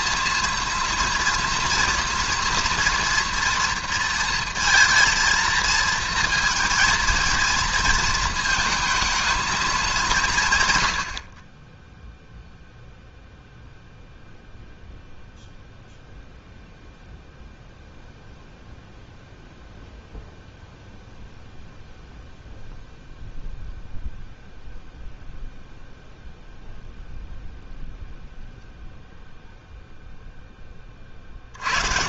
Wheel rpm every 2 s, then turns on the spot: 230, 240, 230, 230, 220, 130, 0, 0, 0, 0, 0, 0, 0, 0, 0, 10.
none